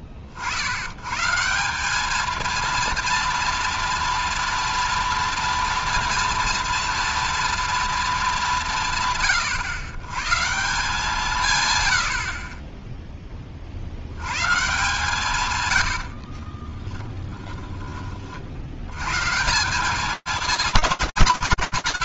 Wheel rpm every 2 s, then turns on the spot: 100, 230, 230, 230, 170, 170, 20, 160, 20, 130, 100.
16-18